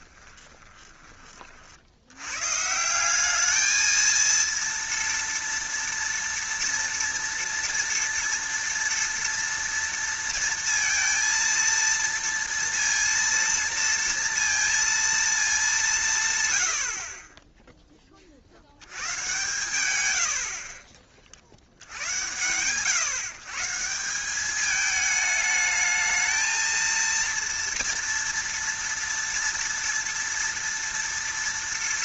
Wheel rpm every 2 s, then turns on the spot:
20, 130, 230, 230, 230, 230, 230, 230, 110, 60, 50, 120, 200, 220, 230, 230.
0-2